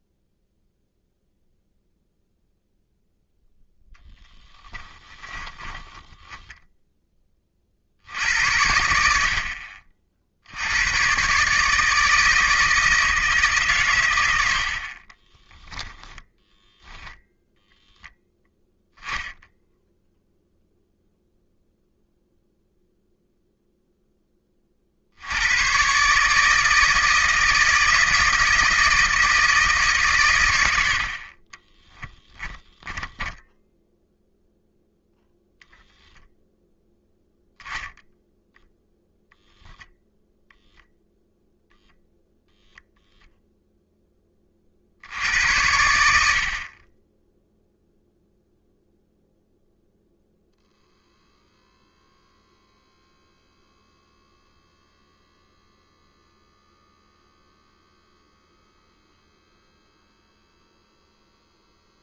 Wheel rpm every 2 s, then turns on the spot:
0, 0, 10, 10, 80, 100, 160, 40, 0, 0, 0, 0, 60, 160, 160, 80, 20, 0, 0, 0, 0, 0, 50, 30, 0, 0, 0, 0, 0, 0, 0.
4-6 32-34